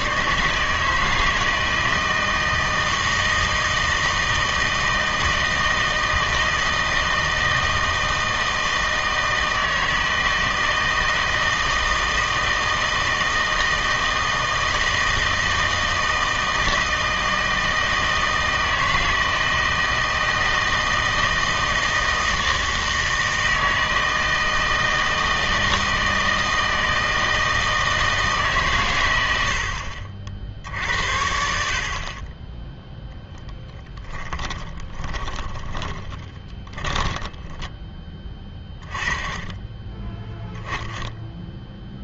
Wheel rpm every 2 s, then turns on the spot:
150, 160, 160, 160, 160, 160, 160, 160, 160, 160, 160, 160, 160, 160, 140, 60, 10, 20, 10, 20, 10.
34-38